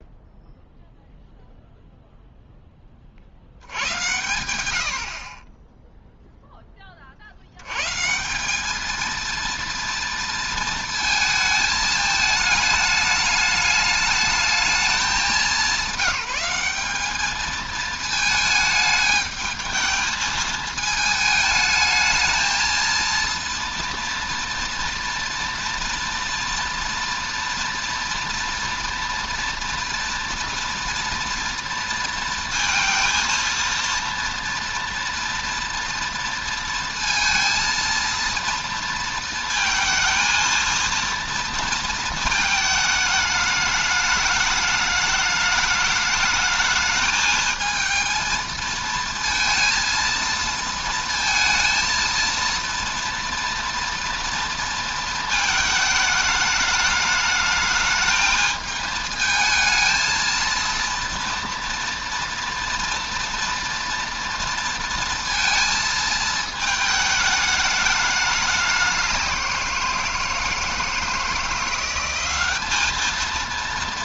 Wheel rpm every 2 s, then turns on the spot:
0, 10, 90, 10, 210, 230, 210, 210, 200, 220, 220, 220, 230, 230, 240, 230, 230, 230, 230, 230, 230, 220, 210, 220, 220, 230, 230, 230, 210, 220, 230, 230, 230, 220, 200, 160, 210.
none